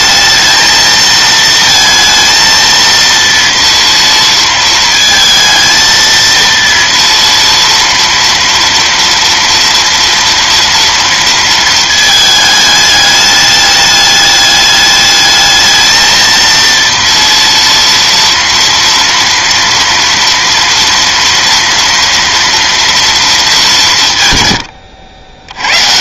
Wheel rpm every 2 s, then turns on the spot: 220, 230, 230, 230, 230, 230, 210, 210, 230, 230, 230, 230, 70.
none